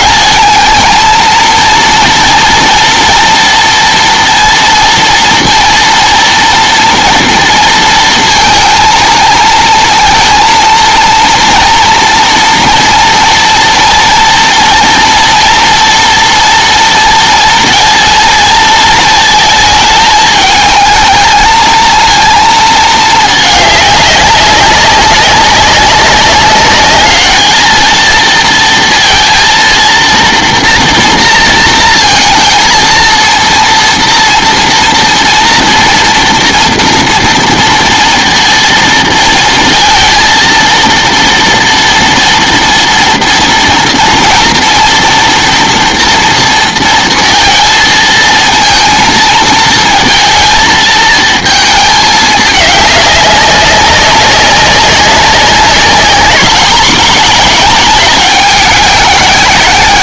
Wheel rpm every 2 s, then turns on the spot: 220, 240, 230, 230, 230, 230, 230, 230, 230, 220, 220, 220, 190, 200, 230, 230, 230, 240, 230, 230, 230, 230, 230, 230, 230, 220, 200, 200, 220, 200.
none